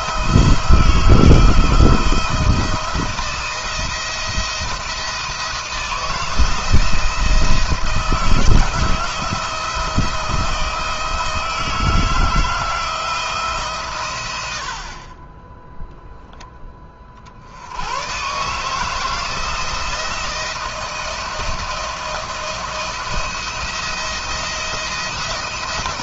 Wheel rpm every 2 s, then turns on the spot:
170, 170, 170, 160, 160, 160, 170, 60, 20, 150, 160, 170, 170.
none